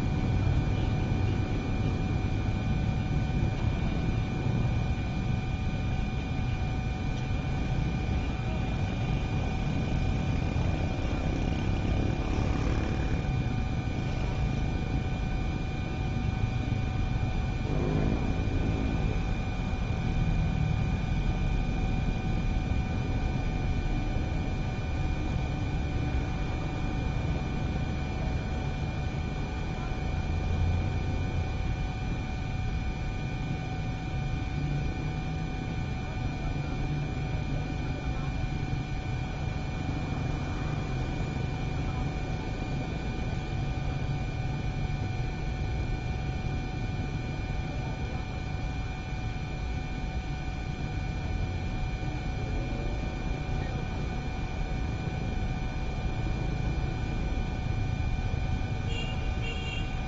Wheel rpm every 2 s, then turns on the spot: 0, 0, 0, 0, 0, 0, 0, 0, 0, 0, 0, 0, 0, 0, 0, 0, 0, 0, 0, 0, 0, 0, 0, 0, 0, 0, 0, 0, 0, 0.
none